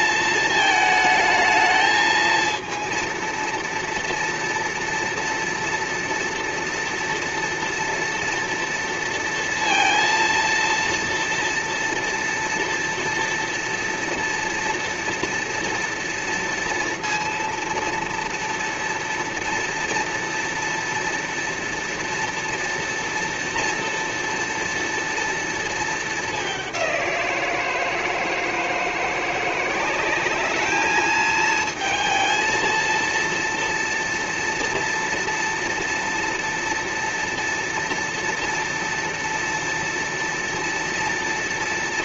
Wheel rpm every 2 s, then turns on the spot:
220, 220, 230, 230, 230, 230, 230, 230, 230, 230, 230, 230, 230, 210, 160, 200, 230, 230, 230, 240, 230.
none